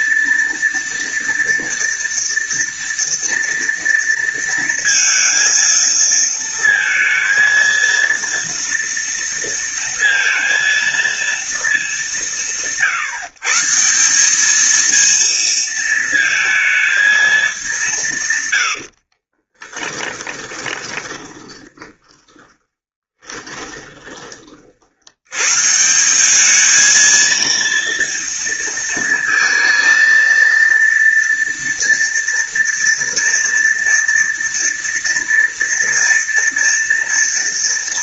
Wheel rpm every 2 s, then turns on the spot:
230, 230, 230, 230, 230, 230, 160, 220, 220, 90, 30, 20, 70, 220, 230, 230, 230, 230, 230.
18-24